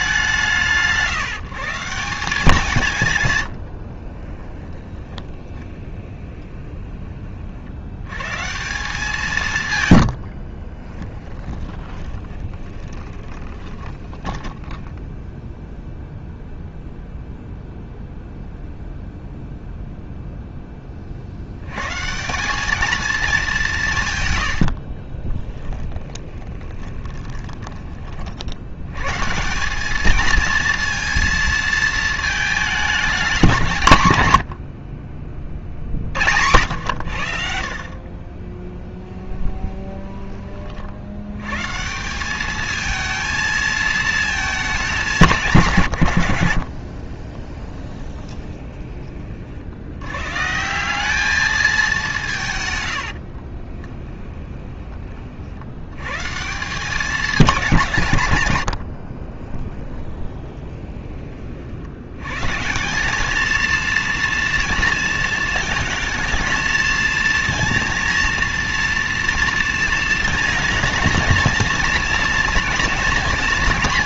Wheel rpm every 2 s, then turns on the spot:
170, 170, 20, 20, 160, 30, 20, 10, 0, 0, 10, 210, 80, 20, 90, 230, 210, 60, 90, 10, 30, 210, 210, 60, 20, 160, 130, 20, 170, 100, 20, 170, 230, 220, 230, 230, 230.
4-6 10-16 24-28 34-36 38-40 46-48 58-62